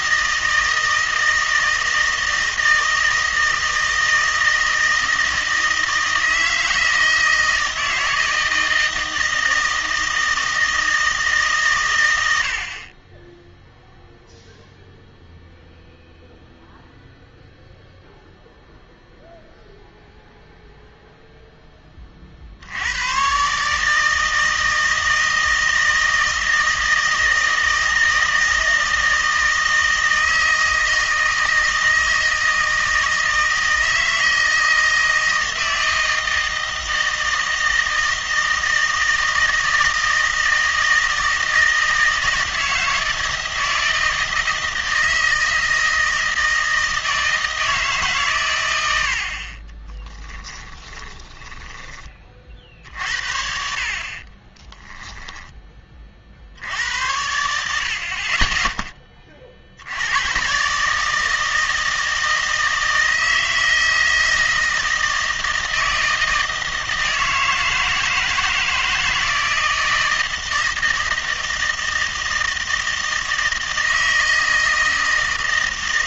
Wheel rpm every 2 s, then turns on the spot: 160, 160, 160, 160, 160, 160, 50, 0, 0, 0, 0, 80, 160, 160, 160, 160, 160, 160, 160, 160, 160, 160, 160, 160, 100, 10, 50, 10, 80, 10, 140, 160, 160, 160, 160, 160, 160, 160.
50-52 54-56